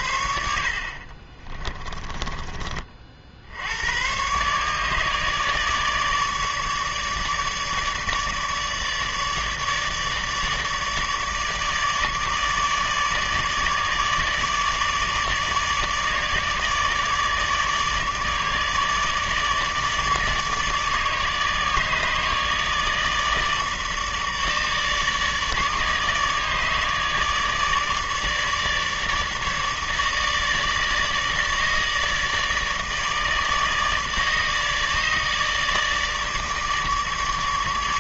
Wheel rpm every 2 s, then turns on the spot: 60, 40, 150, 150, 150, 150, 150, 150, 150, 150, 150, 150, 150, 150, 150, 150, 160, 150, 150.
none